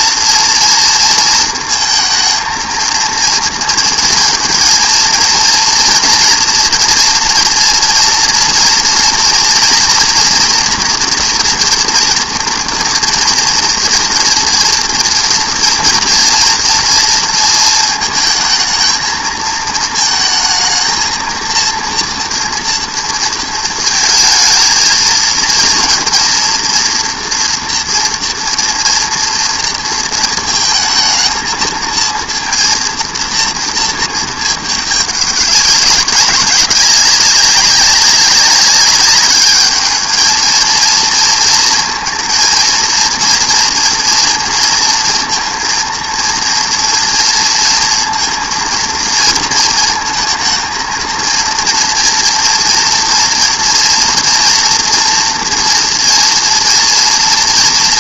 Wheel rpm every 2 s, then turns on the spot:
230, 230, 230, 230, 230, 240, 230, 230, 230, 220, 220, 230, 230, 240, 240, 220, 230, 210, 190, 200, 220, 230, 230, 230, 230, 220, 230, 230, 230.
none